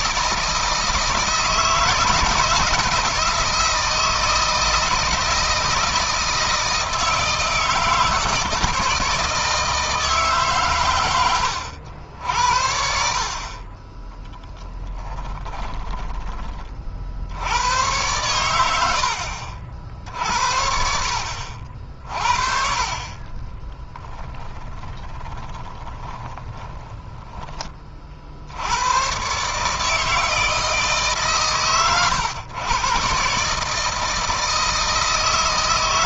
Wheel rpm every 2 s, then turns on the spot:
160, 160, 160, 160, 160, 120, 60, 30, 50, 80, 60, 40, 10, 10, 100, 150, 120, 160.
14-16 18-20 24-28